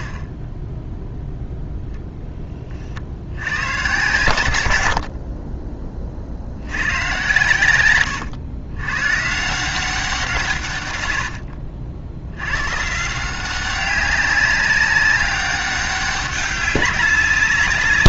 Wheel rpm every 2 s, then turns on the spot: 10, 40, 80, 100, 100, 120, 120, 200, 200.
4-6